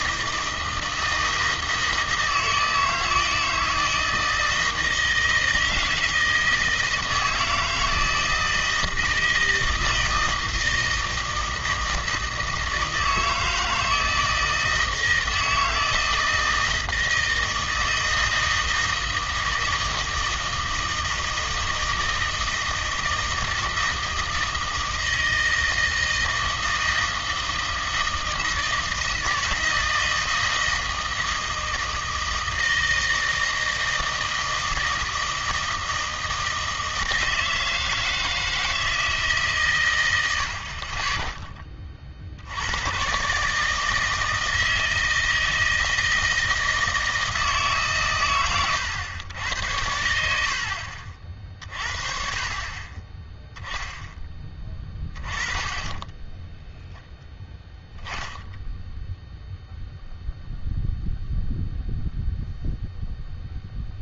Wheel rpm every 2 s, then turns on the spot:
160, 160, 160, 160, 160, 160, 160, 160, 160, 160, 160, 160, 160, 160, 160, 160, 160, 160, 160, 160, 60, 90, 160, 160, 110, 60, 40, 10, 0, 10, 0, 0.
none